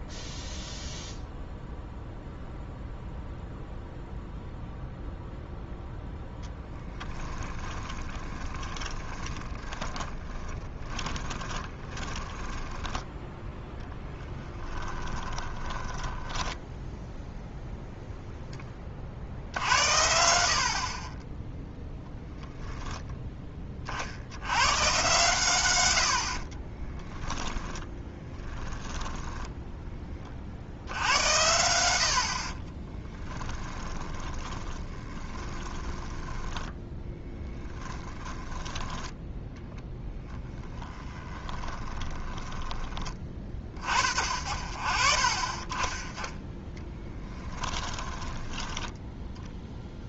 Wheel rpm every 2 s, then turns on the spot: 0, 0, 0, 20, 20, 10, 10, 10, 0, 10, 60, 0, 100, 30, 10, 70, 40, 20, 10, 10, 10, 20, 40, 10, 10.
6-16 26-28 32-42 46-50